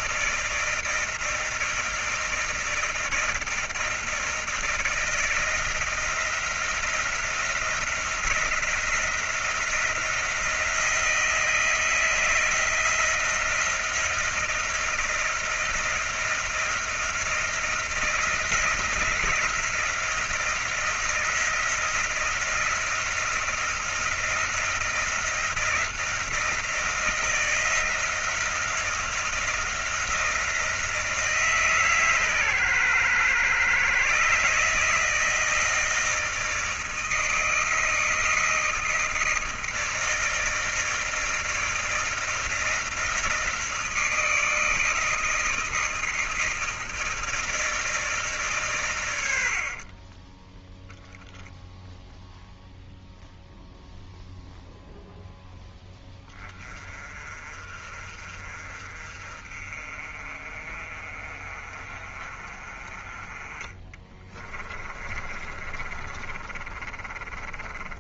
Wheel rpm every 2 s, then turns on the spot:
160, 160, 160, 170, 170, 170, 160, 170, 170, 170, 170, 170, 170, 170, 170, 170, 130, 140, 160, 160, 160, 160, 160, 160, 140, 20, 0, 0, 20, 40, 40, 40, 30, 30.
64-68